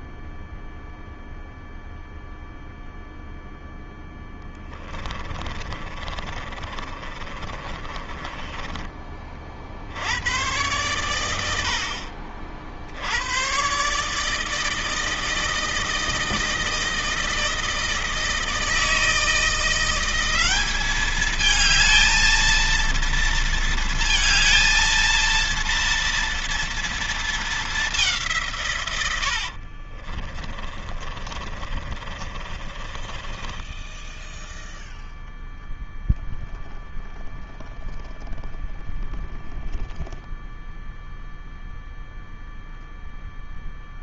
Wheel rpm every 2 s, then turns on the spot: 0, 0, 20, 30, 30, 100, 90, 160, 160, 160, 210, 230, 230, 220, 100, 30, 20, 0, 0, 0, 0, 0.
4-8 28-34